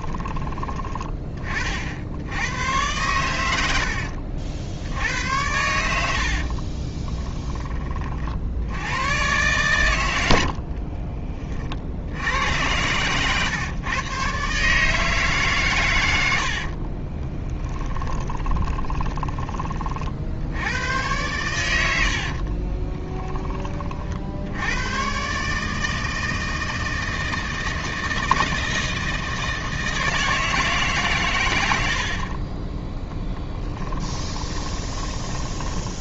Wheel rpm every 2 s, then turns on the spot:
20, 100, 90, 40, 90, 40, 100, 150, 50, 20, 90, 30, 110, 160, 160, 140, 20, 10.
6-8 10-12 16-20 22-24 32-34